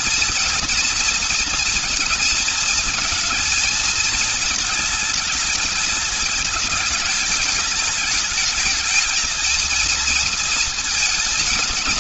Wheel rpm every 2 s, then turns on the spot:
230, 220, 220, 210, 220, 230.
none